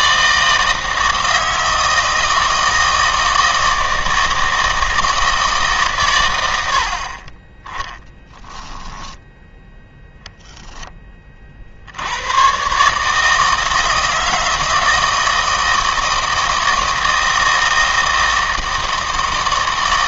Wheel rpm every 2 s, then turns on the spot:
160, 160, 160, 70, 10, 0, 130, 160, 160, 160.
8-10